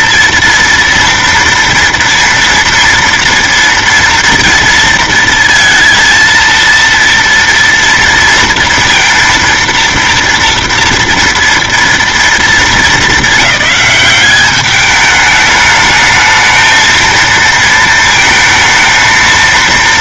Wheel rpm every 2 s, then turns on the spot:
230, 230, 230, 230, 230, 230, 220, 210, 220, 230.
none